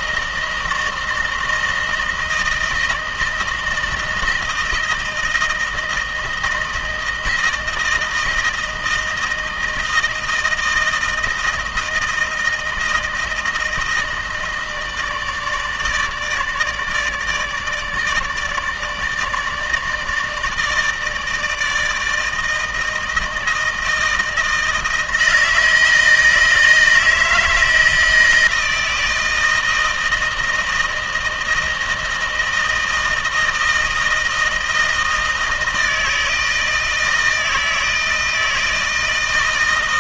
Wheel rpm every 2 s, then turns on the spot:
160, 160, 160, 160, 160, 160, 160, 150, 150, 160, 160, 160, 160, 160, 160, 160, 160, 160, 160, 160.
none